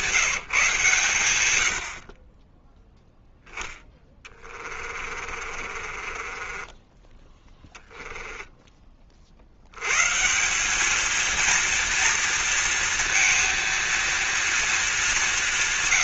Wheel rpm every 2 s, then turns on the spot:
150, 10, 30, 20, 20, 200, 230, 220.
4-8